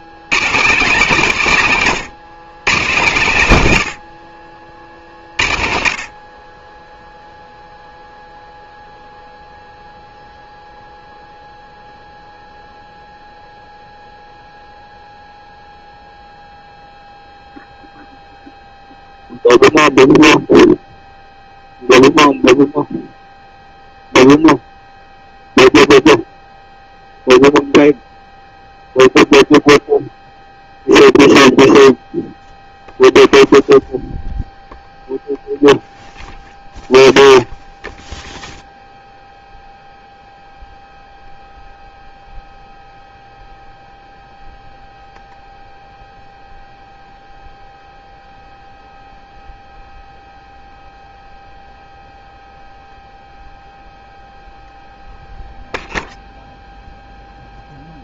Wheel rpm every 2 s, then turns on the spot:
210, 130, 50, 20, 0, 0, 0, 0, 0, 0, 0, 0, 0, 0, 0, 0, 0, 0, 0, 0, 0, 0, 0, 0, 0, 0, 0, 0, 0.
none